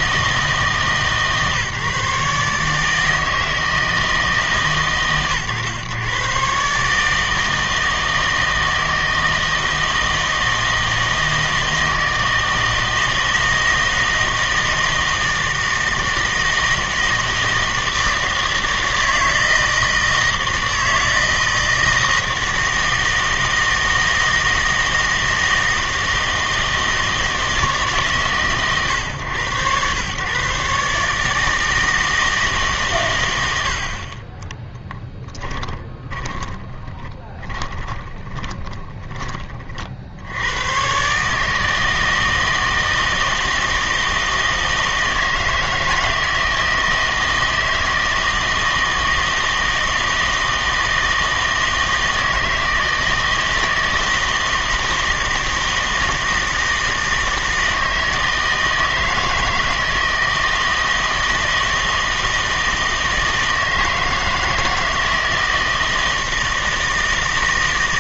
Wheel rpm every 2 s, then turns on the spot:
150, 150, 140, 140, 160, 160, 160, 160, 160, 160, 160, 160, 160, 160, 130, 140, 140, 10, 20, 20, 110, 160, 160, 160, 160, 160, 160, 160, 160, 160, 160, 160, 160, 160.
34-40